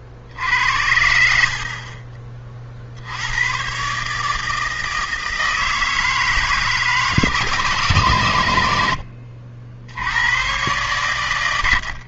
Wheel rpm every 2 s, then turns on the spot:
50, 30, 160, 160, 100, 110.
none